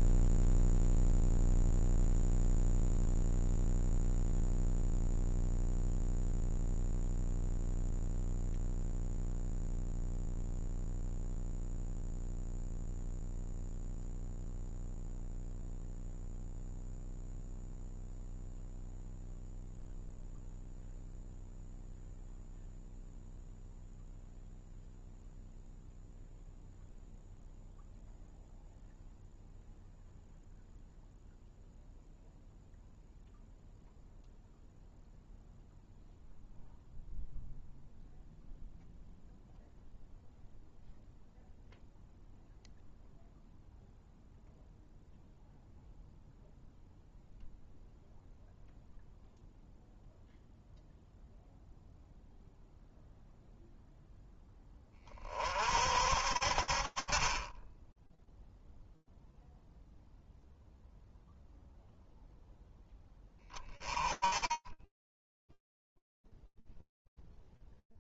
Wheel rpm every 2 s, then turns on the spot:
0, 0, 0, 0, 0, 0, 0, 0, 0, 0, 0, 0, 0, 0, 0, 0, 0, 0, 0, 0, 0, 0, 0, 0, 0, 0, 0, 50, 20, 0, 0, 40, 20, 0.
none